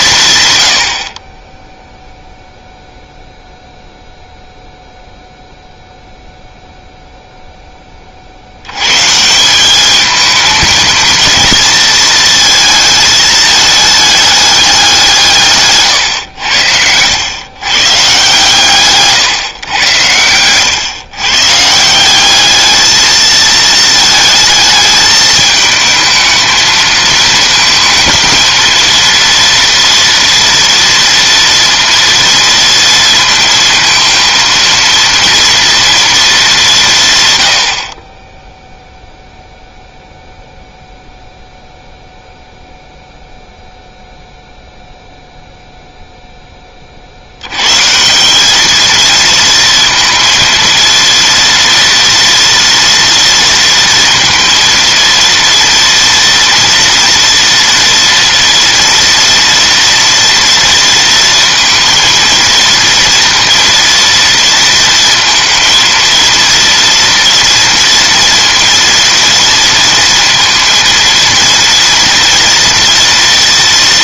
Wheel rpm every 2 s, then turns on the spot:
60, 0, 0, 0, 130, 220, 220, 200, 90, 140, 120, 220, 220, 220, 230, 230, 230, 230, 160, 0, 0, 0, 0, 40, 220, 230, 230, 230, 230, 230, 230, 230, 230, 230, 230, 230, 230.
none